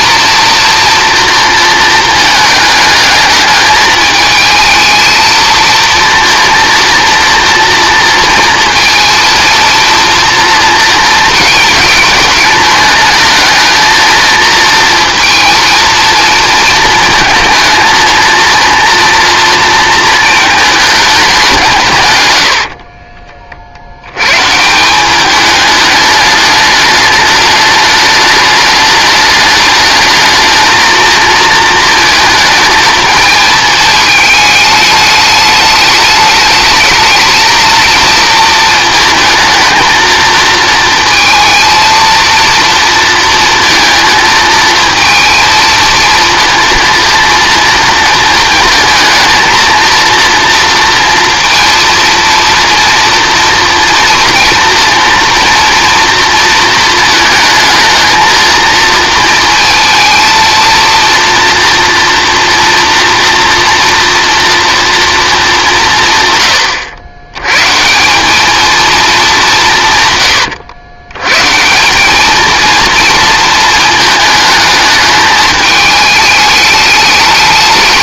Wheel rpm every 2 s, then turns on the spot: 230, 220, 220, 230, 230, 230, 220, 230, 220, 230, 220, 60, 160, 210, 210, 220, 220, 210, 220, 220, 230, 230, 220, 230, 230, 230, 230, 230, 230, 230, 230, 230, 230, 110, 220, 110, 230, 220, 210.
22-24